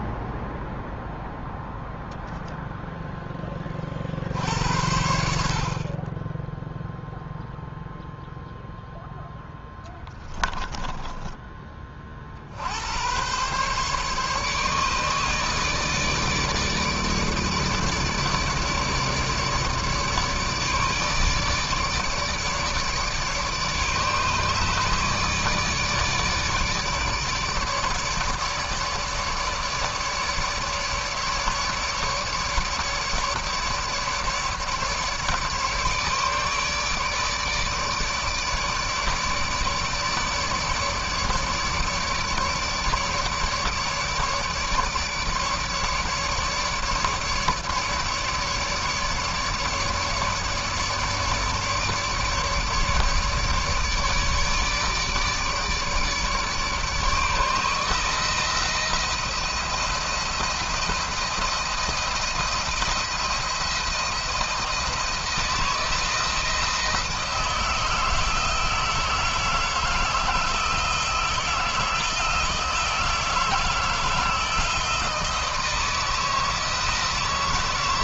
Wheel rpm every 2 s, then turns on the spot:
0, 0, 60, 10, 0, 10, 60, 150, 150, 150, 150, 150, 150, 150, 150, 150, 150, 150, 150, 150, 150, 150, 150, 150, 150, 150, 150, 150, 150, 160, 170, 170, 170, 160, 160, 160, 160, 160, 160.
10-12